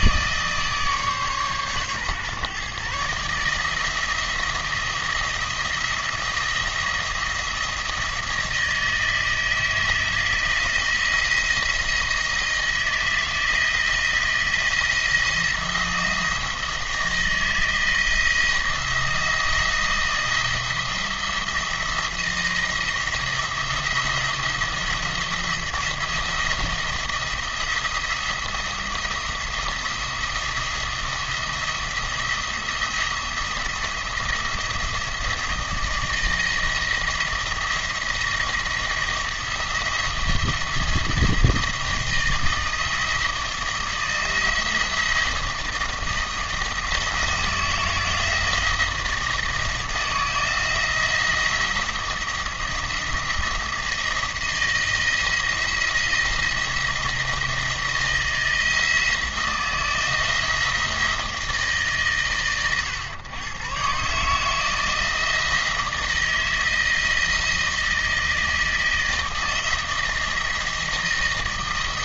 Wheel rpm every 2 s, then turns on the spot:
150, 140, 170, 170, 160, 160, 160, 170, 160, 170, 170, 170, 170, 170, 170, 170, 170, 170, 160, 170, 170, 160, 170, 160, 160, 160, 170, 170, 170, 170, 160, 110, 160, 160, 160, 160.
none